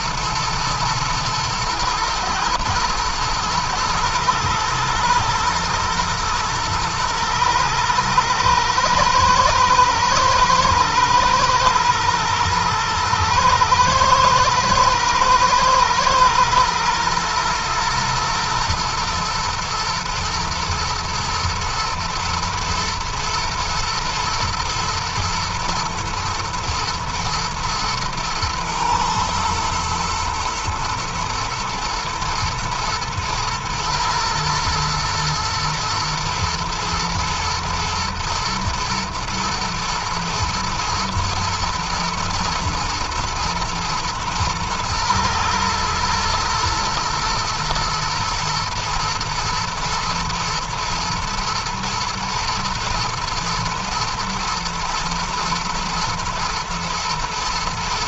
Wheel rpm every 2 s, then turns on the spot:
110, 120, 110, 120, 110, 120, 110, 110, 120, 110, 120, 120, 110, 110, 120, 110, 110, 110, 110, 110, 110, 120, 110, 120, 110, 110, 120, 120, 110.
none